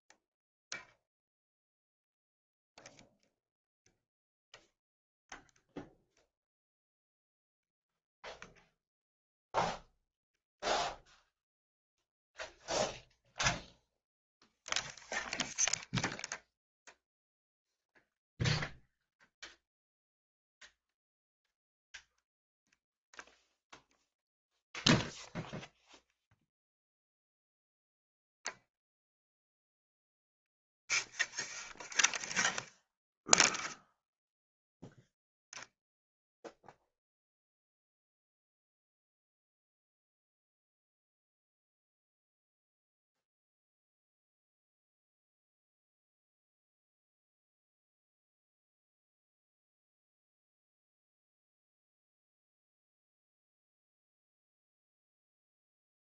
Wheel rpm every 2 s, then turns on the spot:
0, 0, 0, 0, 0, 0, 0, 0, 0, 0, 0, 0, 0, 0, 0, 0, 0, 0, 0, 0, 0, 0, 0, 0, 0, 0, 0, 0.
none